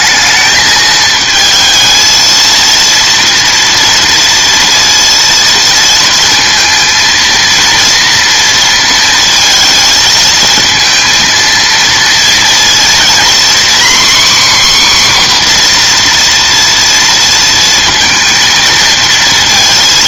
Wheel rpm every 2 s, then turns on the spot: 220, 230, 230, 230, 230, 230, 240, 270, 230, 230.
none